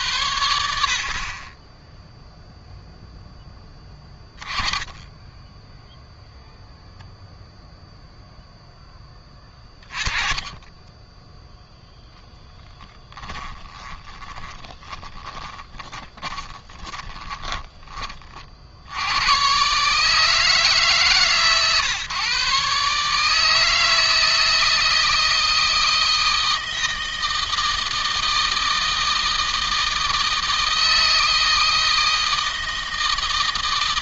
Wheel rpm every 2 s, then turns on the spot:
60, 0, 10, 0, 10, 20, 10, 20, 10, 80, 140, 150, 160, 160, 160, 160, 160.
12-18